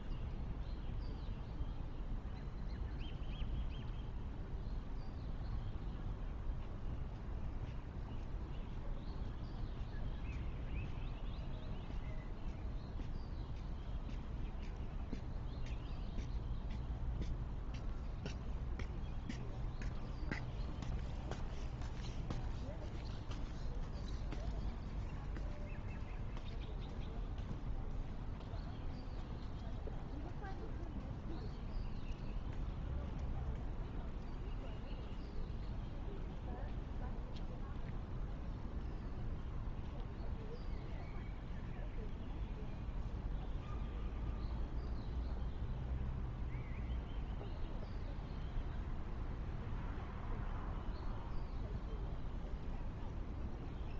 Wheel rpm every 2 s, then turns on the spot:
0, 0, 0, 0, 0, 0, 0, 0, 0, 0, 0, 0, 0, 0, 0, 0, 0, 0, 0, 0, 0, 0, 0, 0, 0, 0, 0.
none